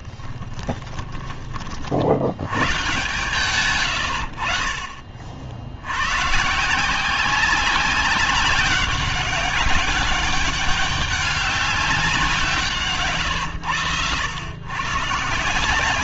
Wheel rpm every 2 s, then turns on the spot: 10, 100, 60, 150, 200, 200, 160, 120.
0-2